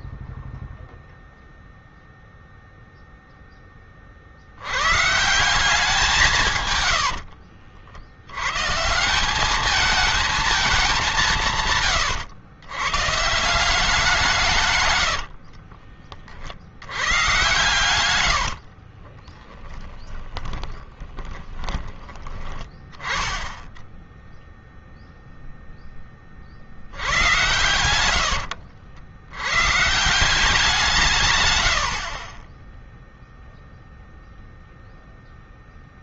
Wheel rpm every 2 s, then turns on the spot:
0, 0, 100, 120, 130, 210, 110, 130, 80, 50, 20, 10, 0, 60, 70, 170, 10, 0.
6-8 14-16 18-22